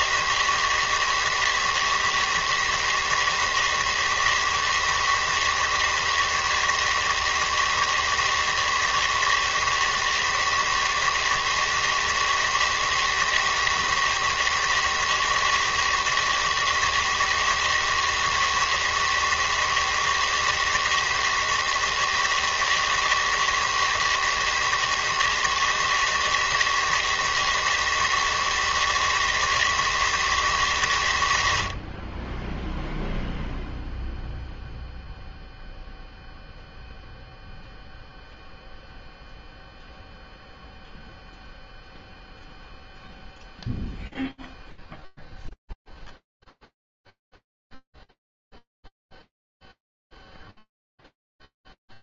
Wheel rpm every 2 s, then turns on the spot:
160, 160, 160, 160, 160, 160, 160, 160, 160, 160, 160, 160, 160, 160, 160, 160, 20, 0, 0, 0, 0, 0, 0, 0, 0, 0.
none